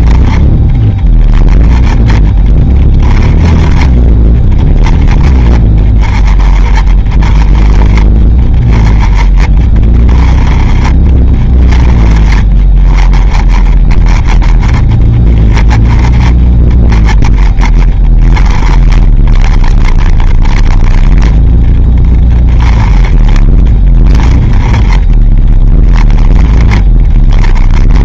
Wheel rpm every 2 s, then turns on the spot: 20, 20, 20, 20, 20, 20, 20, 20, 20, 30, 20, 20, 20, 20.
none